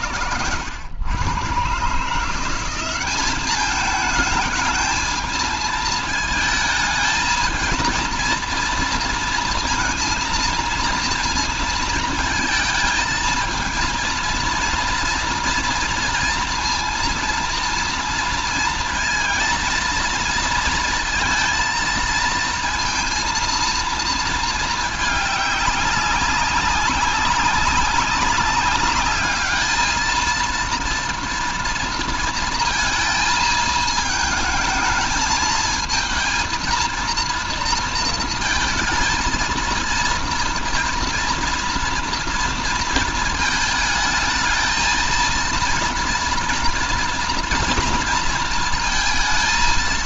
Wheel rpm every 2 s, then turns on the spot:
100, 180, 220, 220, 230, 230, 220, 230, 230, 230, 230, 230, 220, 200, 200, 230, 230, 220, 230, 220, 230, 230, 230, 230, 230.
none